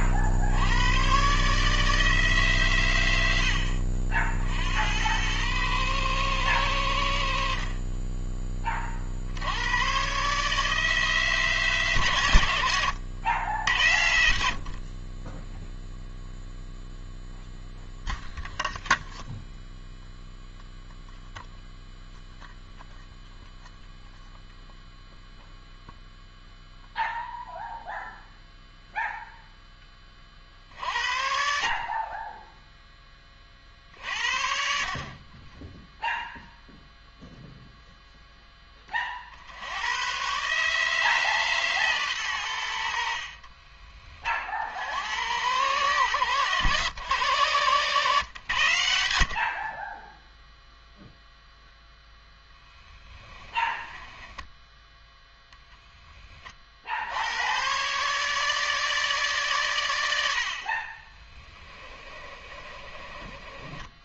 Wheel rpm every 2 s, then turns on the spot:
70, 140, 70, 110, 20, 140, 110, 60, 0, 0, 0, 0, 0, 0, 0, 40, 10, 50, 0, 10, 130, 100, 50, 120, 110, 0, 10, 10, 30, 150, 60, 30.
30-34 60-64